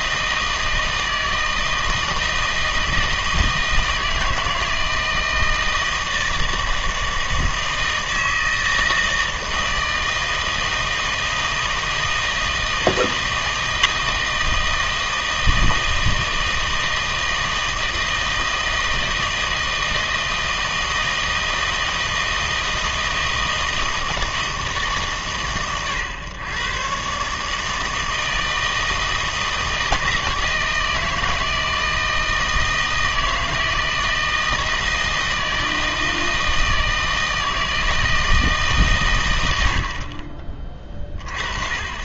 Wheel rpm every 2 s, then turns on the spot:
160, 160, 160, 160, 160, 160, 160, 160, 160, 160, 160, 160, 160, 120, 160, 160, 160, 160, 160, 150, 30.
none